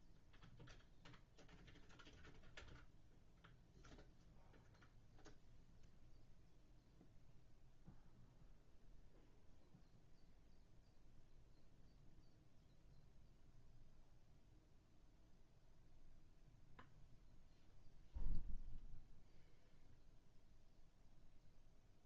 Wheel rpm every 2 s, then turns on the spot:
0, 0, 0, 0, 0, 0, 0, 0, 0, 0, 0.
none